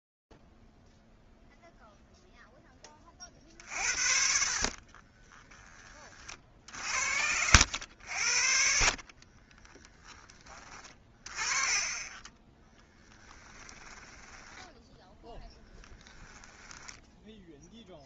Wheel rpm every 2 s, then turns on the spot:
0, 0, 50, 50, 60, 30, 10, 10, 0.
12-16